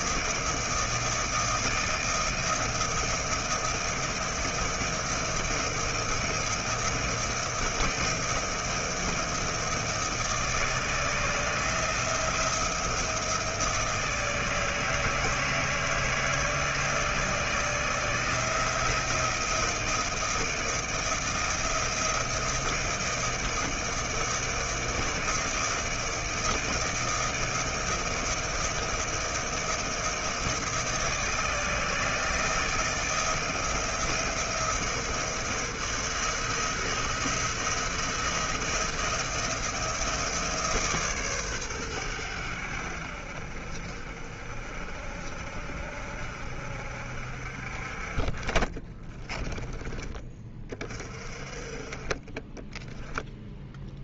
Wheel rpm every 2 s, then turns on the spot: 160, 160, 160, 160, 160, 160, 170, 160, 160, 160, 160, 160, 160, 160, 160, 160, 160, 170, 160, 170, 160, 90, 50, 60, 30, 20, 20.
none